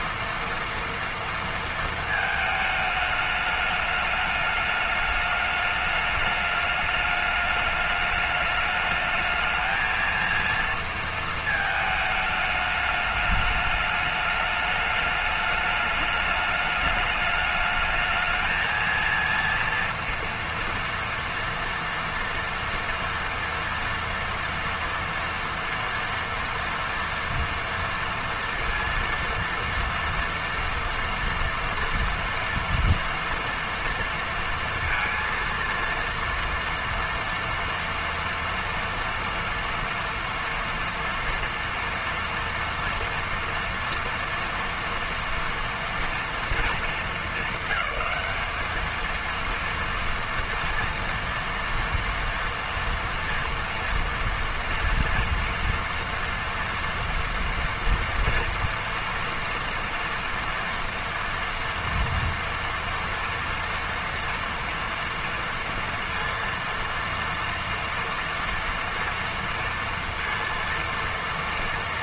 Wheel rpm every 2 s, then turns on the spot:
230, 210, 210, 210, 210, 220, 210, 210, 210, 230, 240, 230, 230, 230, 230, 230, 230, 230, 230, 230, 230, 230, 230, 210, 220, 230, 240, 230, 230, 230, 230, 230, 230, 230, 230, 230.
none